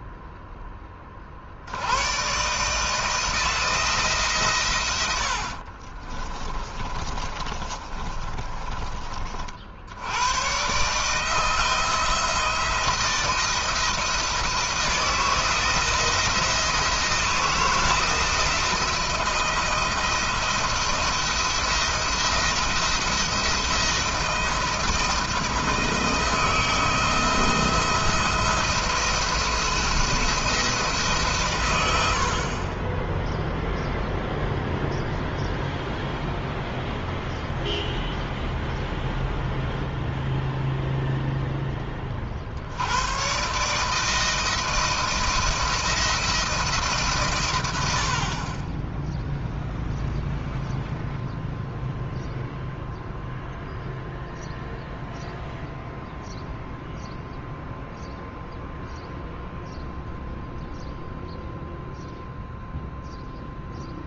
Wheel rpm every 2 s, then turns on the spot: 20, 150, 120, 30, 30, 140, 160, 170, 170, 170, 170, 170, 160, 160, 170, 160, 30, 0, 0, 0, 0, 90, 170, 150, 10, 0, 0, 0, 0, 0, 0, 0.
6-8